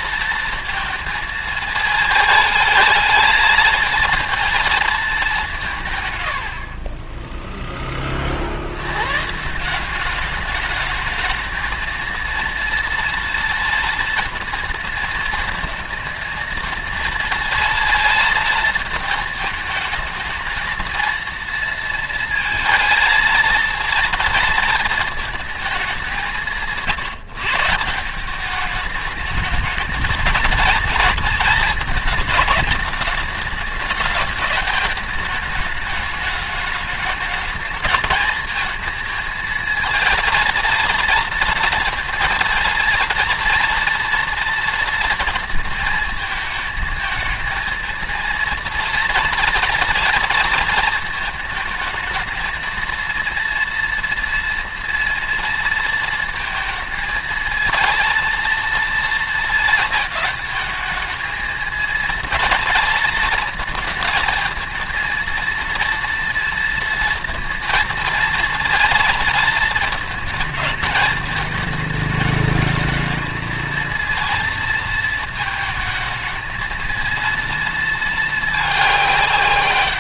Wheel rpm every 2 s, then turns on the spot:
230, 220, 220, 80, 70, 210, 230, 230, 220, 230, 230, 230, 230, 180, 200, 230, 210, 210, 220, 220, 230, 230, 230, 220, 230, 230, 230, 230, 230, 230, 220, 230, 220, 230, 230, 220, 220, 230, 230, 210.
6-8